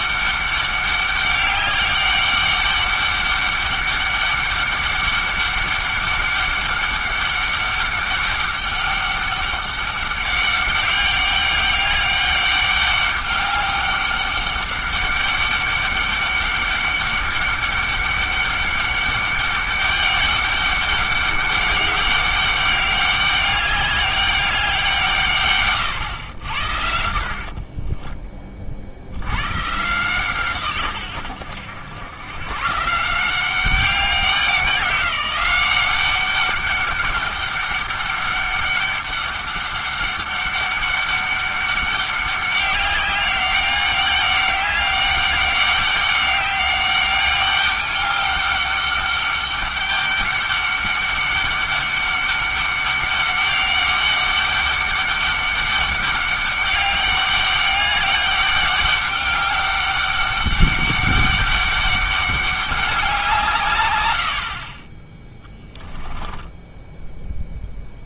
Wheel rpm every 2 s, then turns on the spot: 200, 200, 200, 200, 200, 200, 200, 200, 200, 200, 200, 200, 190, 80, 50, 130, 130, 190, 200, 200, 200, 190, 200, 200, 200, 200, 200, 200, 200, 200, 200, 200, 30, 10.
66-68